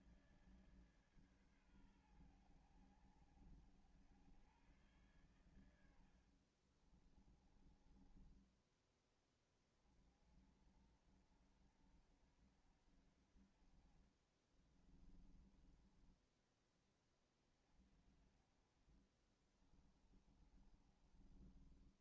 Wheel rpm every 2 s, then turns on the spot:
160, 110, 100, 80, 20, 50, 60, 40, 20, 40, 30.
6-8 14-16 20-22